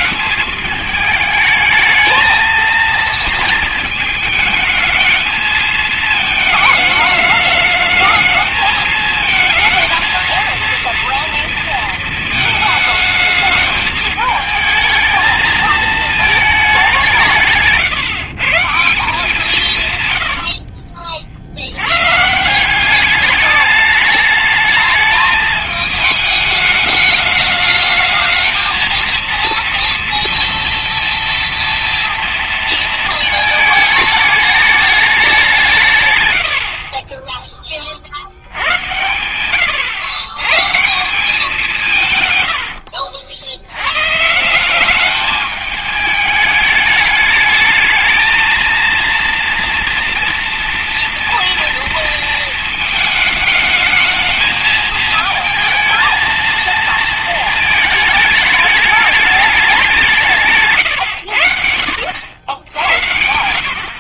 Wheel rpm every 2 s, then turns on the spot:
210, 230, 220, 220, 220, 230, 220, 220, 210, 150, 70, 160, 210, 210, 220, 230, 230, 210, 100, 70, 110, 110, 160, 210, 220, 230, 220, 220, 230, 220, 150, 70.
20-22 42-44